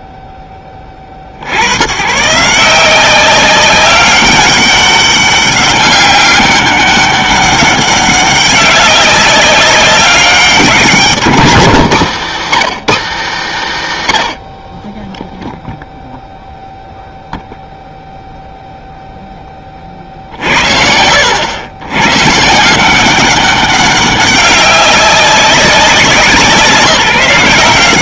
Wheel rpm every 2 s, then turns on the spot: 80, 190, 200, 200, 190, 140, 120, 0, 0, 10, 70, 190, 190, 170.
none